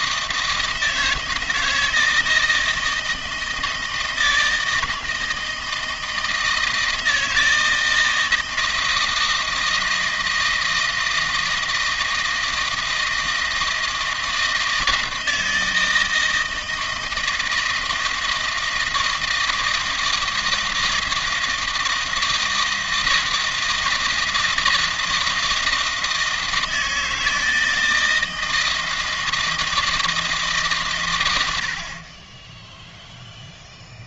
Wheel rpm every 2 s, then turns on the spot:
160, 160, 160, 160, 160, 160, 160, 160, 160, 160, 170, 160, 160, 160, 160, 150, 10.
none